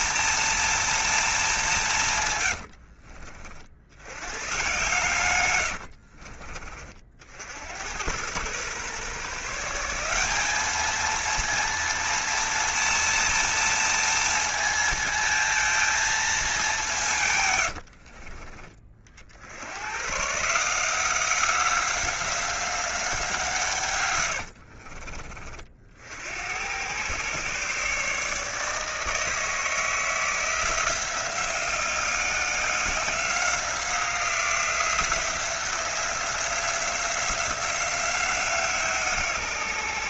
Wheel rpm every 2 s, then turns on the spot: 230, 90, 110, 50, 120, 210, 230, 230, 190, 50, 160, 190, 70, 100, 150, 170, 180, 170, 180, 170.
2-4 24-26